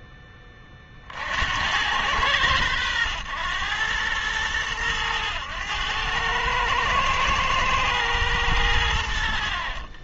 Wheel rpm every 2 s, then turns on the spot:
30, 100, 100, 110, 90.
none